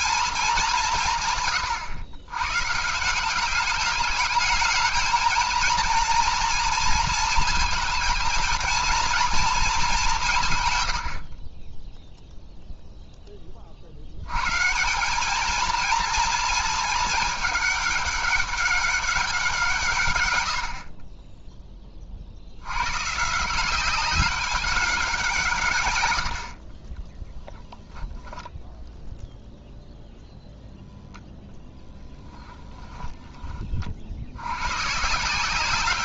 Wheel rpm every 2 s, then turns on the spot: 190, 130, 210, 230, 230, 130, 0, 150, 220, 200, 70, 90, 200, 50, 0, 0, 10, 110.
32-34